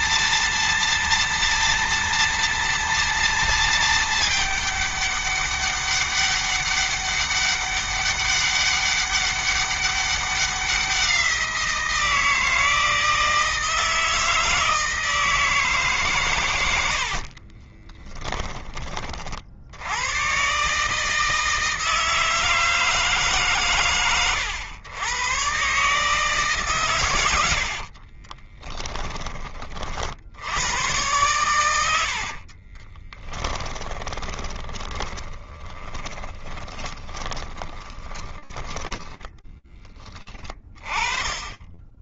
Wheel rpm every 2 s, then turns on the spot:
230, 230, 210, 200, 200, 180, 160, 160, 70, 30, 150, 160, 110, 120, 20, 110, 30, 20, 10, 10, 20.
16-18 26-28 32-38